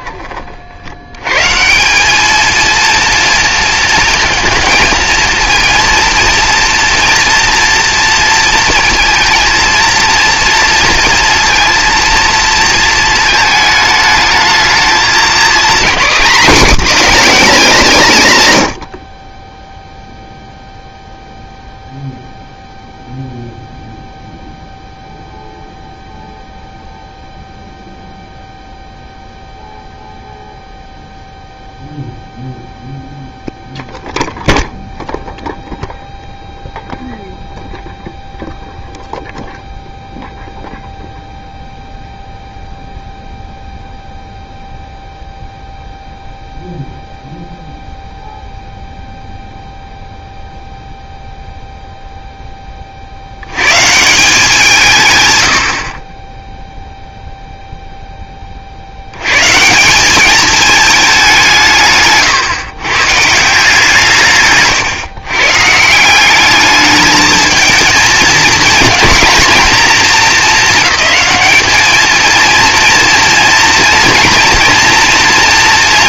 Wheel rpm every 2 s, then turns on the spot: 50, 220, 230, 230, 230, 230, 230, 220, 250, 120, 0, 0, 0, 0, 0, 0, 0, 0, 0, 0, 0, 0, 0, 0, 0, 0, 20, 180, 0, 40, 210, 130, 130, 210, 220, 220, 230, 230.
64-66